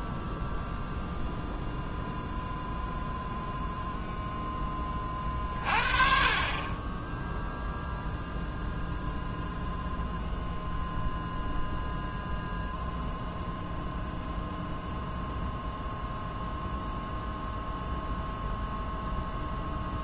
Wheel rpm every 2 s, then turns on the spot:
0, 0, 10, 30, 0, 0, 0, 0, 0, 0.
none